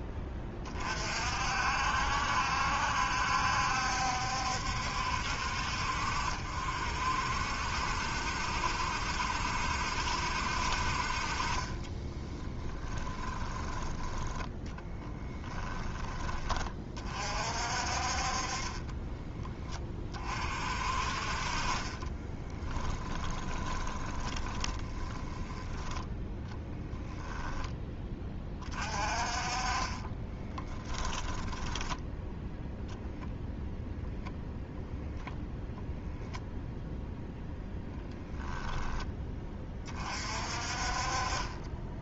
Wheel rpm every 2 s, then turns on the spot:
30, 70, 70, 60, 70, 50, 20, 10, 40, 20, 40, 20, 20, 10, 30, 10, 0, 0, 0, 10, 40.
12-16 18-20 22-28 30-32